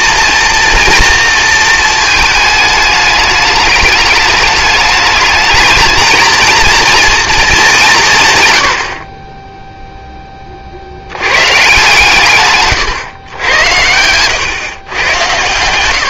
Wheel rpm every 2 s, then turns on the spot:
230, 220, 210, 230, 100, 50, 130, 120.
12-14